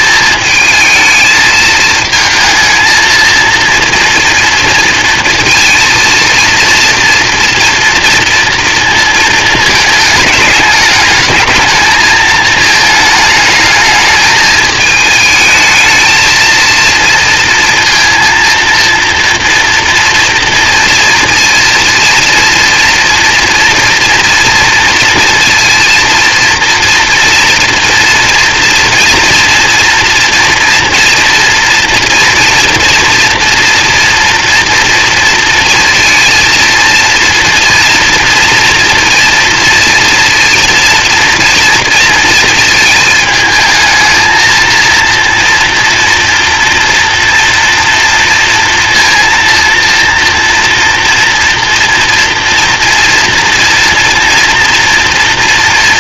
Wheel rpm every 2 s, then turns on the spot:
220, 220, 230, 230, 230, 210, 220, 220, 230, 230, 230, 230, 230, 230, 230, 240, 230, 230, 230, 230, 230, 220, 220, 230, 230, 230, 230, 230.
none